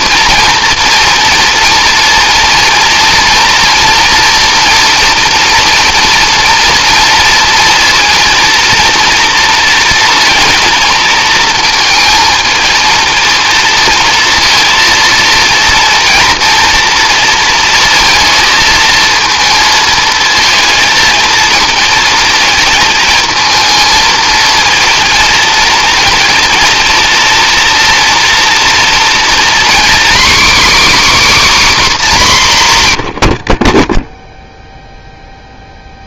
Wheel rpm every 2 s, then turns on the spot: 230, 230, 240, 230, 230, 230, 230, 230, 230, 220, 230, 220, 220, 230, 230, 290, 150, 0.
none